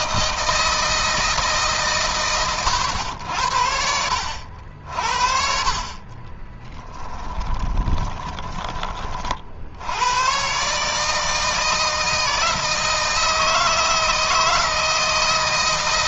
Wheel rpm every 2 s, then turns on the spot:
160, 100, 60, 10, 20, 140, 160, 160.
6-8